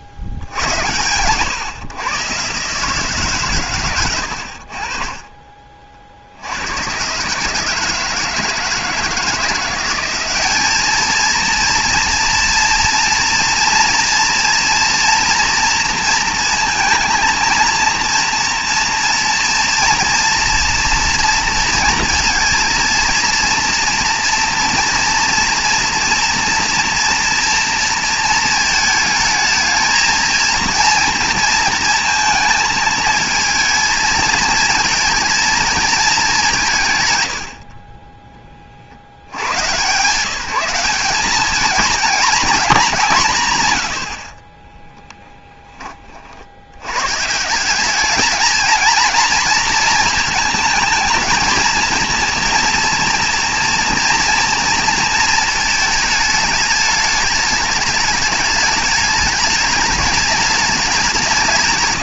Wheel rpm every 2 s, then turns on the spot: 80, 140, 60, 100, 160, 210, 240, 240, 220, 230, 230, 230, 230, 230, 220, 230, 220, 220, 160, 50, 190, 210, 20, 110, 230, 220, 230, 230, 210, 210, 190.
44-46